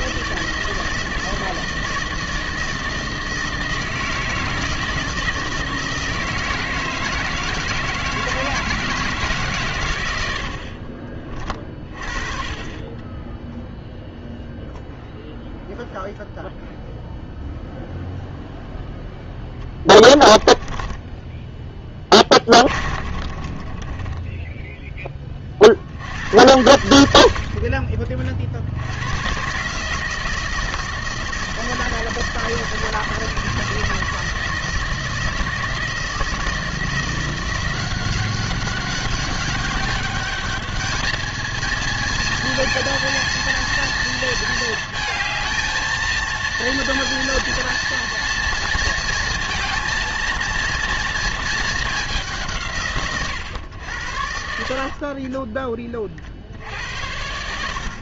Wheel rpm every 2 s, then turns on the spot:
160, 160, 160, 160, 160, 60, 30, 0, 0, 0, 20, 30, 10, 90, 70, 160, 160, 160, 160, 190, 210, 230, 220, 230, 230, 230, 160, 60, 70.
20-24 54-56